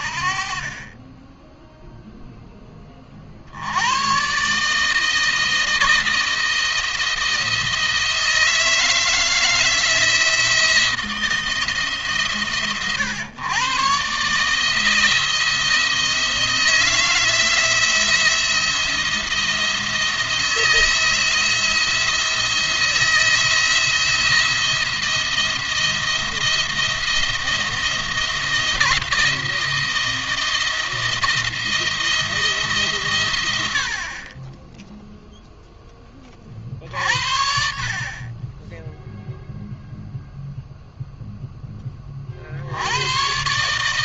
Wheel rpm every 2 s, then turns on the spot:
30, 10, 140, 170, 160, 160, 130, 160, 160, 170, 170, 170, 170, 170, 170, 170, 150, 10, 30, 10, 0, 70.
none